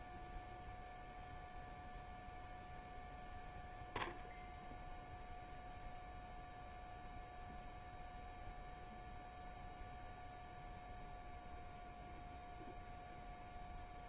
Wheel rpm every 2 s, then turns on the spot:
0, 0, 0, 0, 0, 0, 0.
none